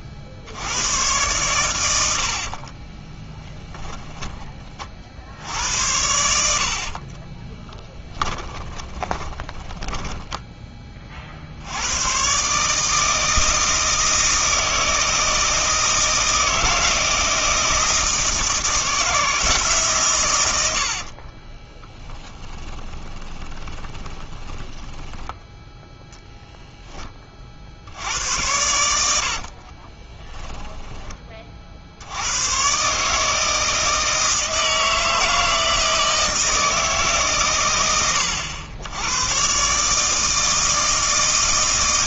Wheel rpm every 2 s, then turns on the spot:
90, 40, 30, 60, 20, 20, 150, 160, 160, 160, 90, 10, 20, 10, 100, 20, 130, 160, 160, 90, 160.
2-4 6-10 20-26 30-32